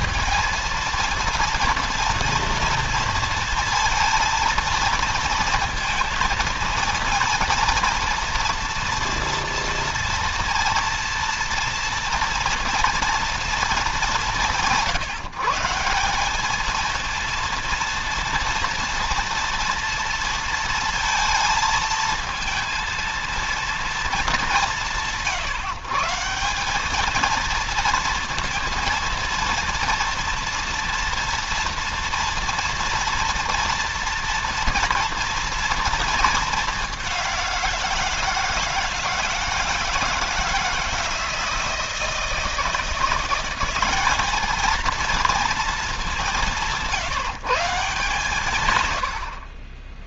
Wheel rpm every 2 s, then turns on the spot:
230, 230, 230, 230, 230, 230, 230, 160, 230, 230, 230, 230, 170, 210, 230, 230, 230, 240, 210, 160, 170, 170, 220, 170, 100.
none